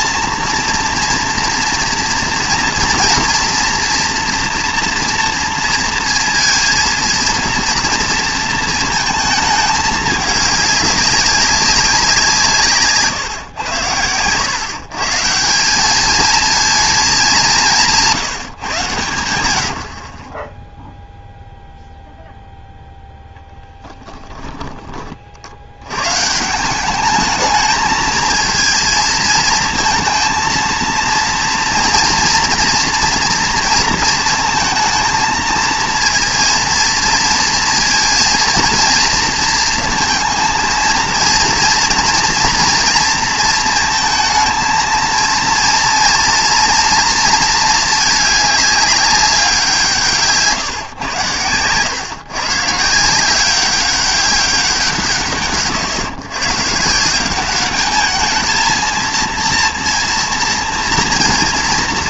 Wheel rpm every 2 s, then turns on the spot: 230, 230, 240, 230, 230, 200, 160, 120, 220, 150, 10, 0, 10, 170, 220, 230, 230, 230, 230, 230, 230, 230, 220, 230, 210, 130, 140, 190, 140, 220, 230.
none